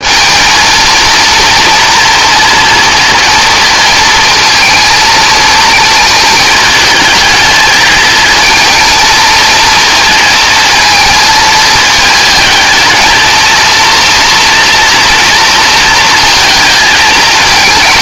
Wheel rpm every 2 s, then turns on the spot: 210, 230, 220, 220, 230, 230, 220, 240, 230.
none